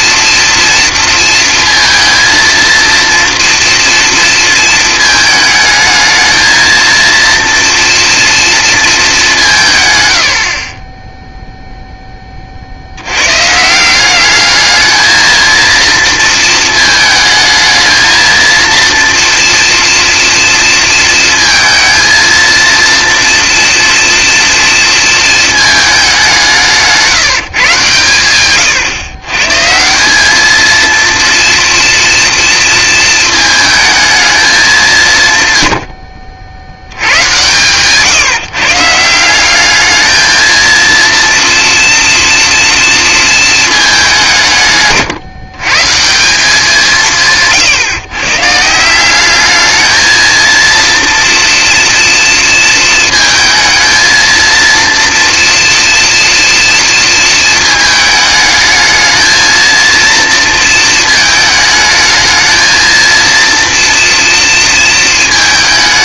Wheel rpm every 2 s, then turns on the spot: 230, 230, 220, 230, 230, 50, 50, 210, 220, 230, 230, 230, 240, 180, 120, 220, 230, 200, 70, 140, 230, 230, 150, 180, 150, 230, 230, 230, 230, 220, 230, 220, 230.
10-12 28-30